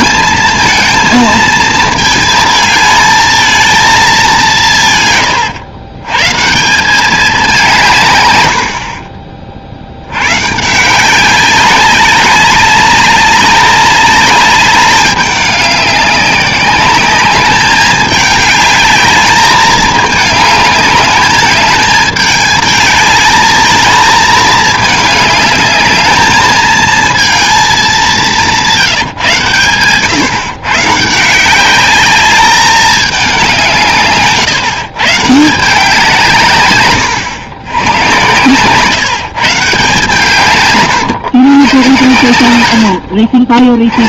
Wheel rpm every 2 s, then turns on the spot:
230, 220, 170, 160, 80, 140, 190, 200, 200, 210, 210, 210, 220, 220, 170, 150, 210, 150, 130, 120, 130, 80.
8-10